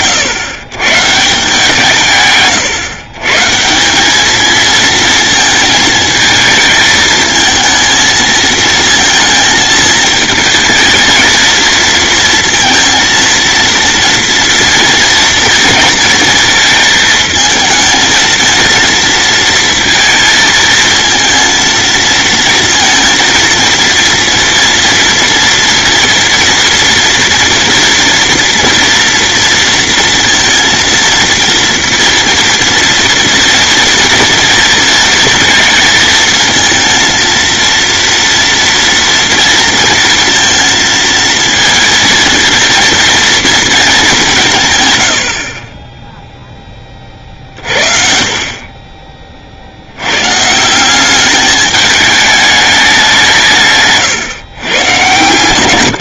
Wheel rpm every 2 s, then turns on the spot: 140, 130, 230, 220, 230, 220, 230, 230, 220, 230, 220, 230, 230, 230, 230, 230, 230, 230, 230, 230, 230, 230, 120, 30, 30, 190, 200, 120.
none